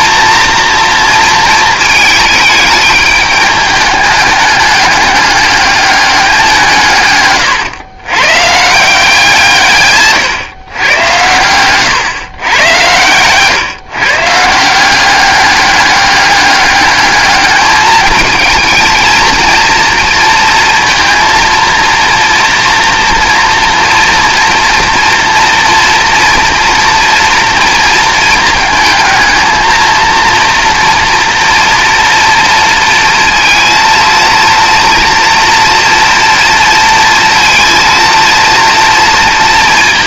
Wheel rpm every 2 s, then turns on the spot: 230, 210, 200, 160, 150, 120, 110, 170, 210, 220, 230, 240, 230, 230, 220, 230, 230, 230, 230, 230.
none